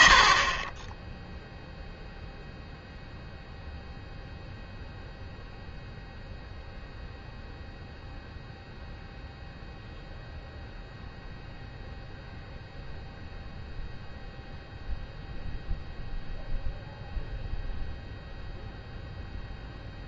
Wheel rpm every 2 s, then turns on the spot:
30, 0, 0, 0, 0, 0, 0, 0, 0, 0.
none